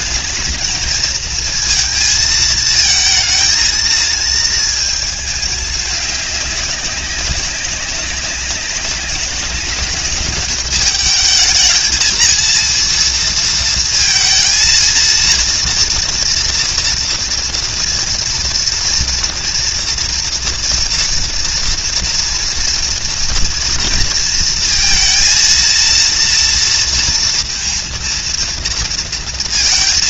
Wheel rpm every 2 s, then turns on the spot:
230, 220, 220, 200, 200, 210, 230, 230, 230, 230, 240, 230, 230, 230, 230.
none